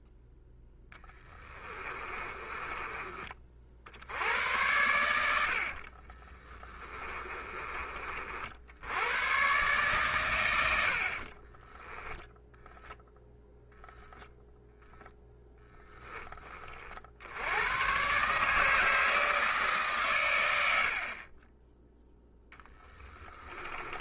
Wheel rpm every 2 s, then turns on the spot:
0, 30, 80, 20, 90, 80, 0, 0, 50, 160, 50, 10.
6-8 20-22